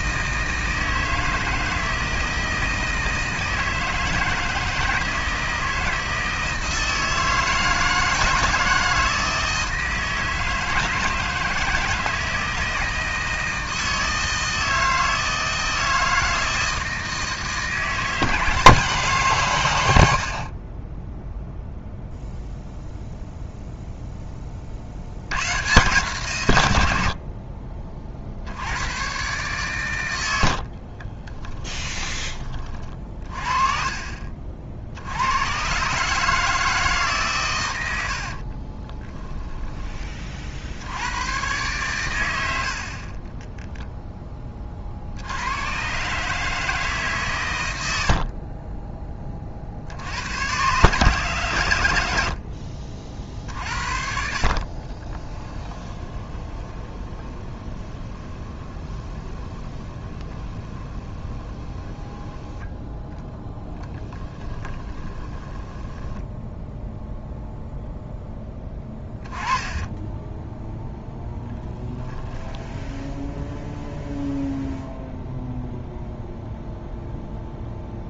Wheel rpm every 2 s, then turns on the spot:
160, 160, 160, 160, 160, 160, 160, 160, 160, 160, 20, 0, 60, 80, 100, 40, 40, 70, 150, 20, 80, 60, 50, 150, 30, 130, 50, 40, 20, 20, 20, 10, 20, 0, 10, 0, 0, 0, 0.
30-32 38-40 52-62 64-66 68-70